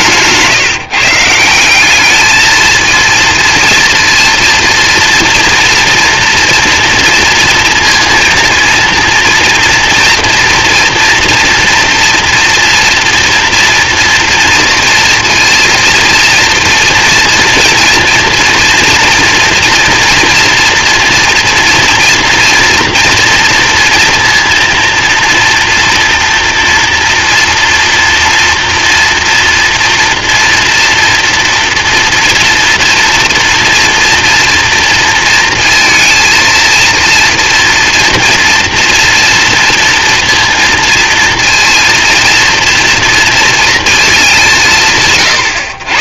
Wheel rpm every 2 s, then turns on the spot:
160, 230, 230, 230, 230, 230, 230, 230, 230, 230, 240, 230, 230, 240, 230, 230, 240, 230, 230, 230, 230, 230, 150.
none